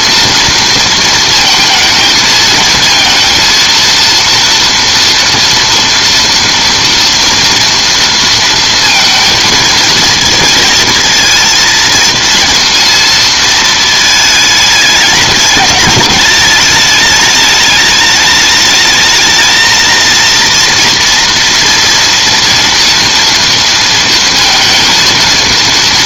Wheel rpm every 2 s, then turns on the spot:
230, 230, 240, 230, 230, 230, 230, 210, 210, 220, 230, 230, 230.
none